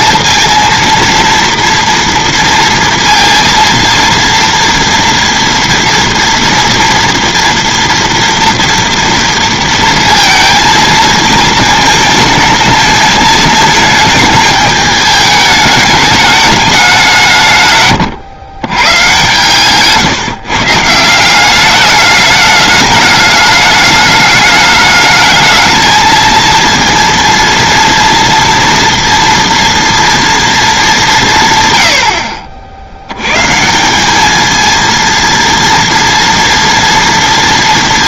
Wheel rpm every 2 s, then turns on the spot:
230, 230, 230, 230, 230, 230, 220, 220, 210, 110, 140, 210, 220, 230, 230, 230, 60, 220, 230.
none